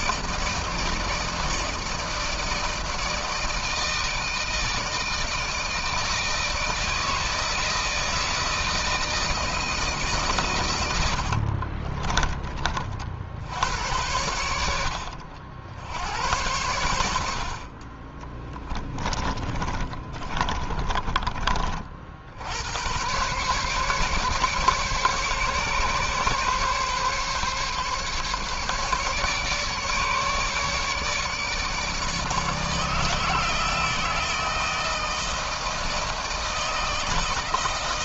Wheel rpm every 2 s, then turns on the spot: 160, 160, 160, 160, 160, 110, 40, 80, 90, 20, 30, 100, 140, 140, 140, 150, 150, 160, 160.
18-22